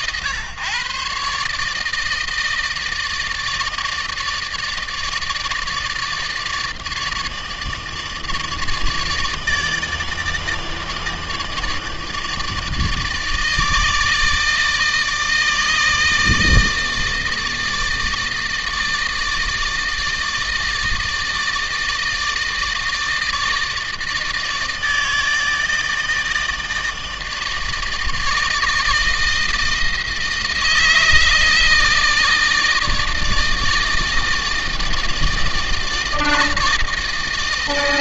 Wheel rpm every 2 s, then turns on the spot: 140, 160, 160, 150, 160, 160, 150, 150, 160, 160, 160, 150, 160, 160, 160, 160, 160, 160, 160.
none